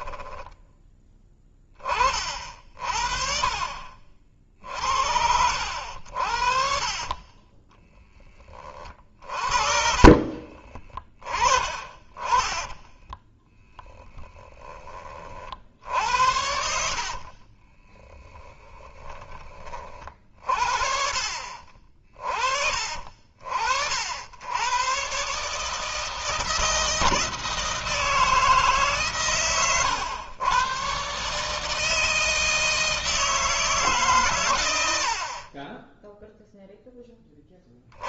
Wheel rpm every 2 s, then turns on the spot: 10, 50, 60, 50, 20, 40, 20, 30, 60, 10, 50, 50, 100, 160, 150, 120, 160, 110, 0.
0-2 6-8 10-18